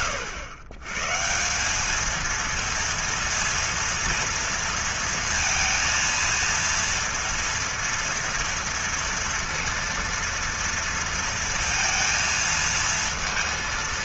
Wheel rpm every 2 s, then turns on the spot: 110, 230, 230, 230, 230, 230, 230.
none